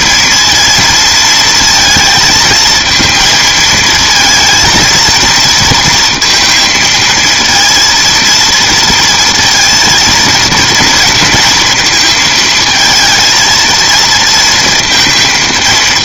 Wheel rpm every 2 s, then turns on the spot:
230, 230, 230, 230, 230, 230, 220, 220.
none